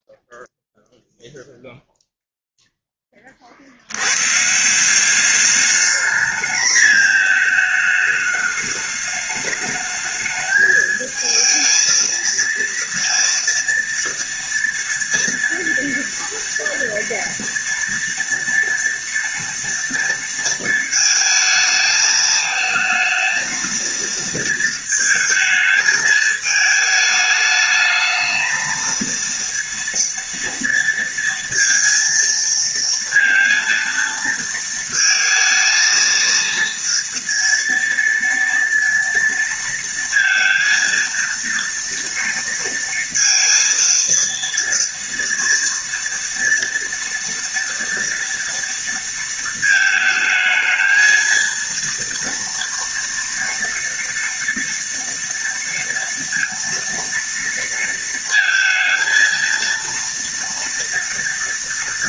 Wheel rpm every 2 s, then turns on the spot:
0, 0, 160, 220, 210, 220, 230, 230, 230, 230, 230, 220, 230, 220, 230, 230, 230, 230, 230, 230, 230, 230, 230, 230, 230, 220, 230, 230, 230, 230, 230.
none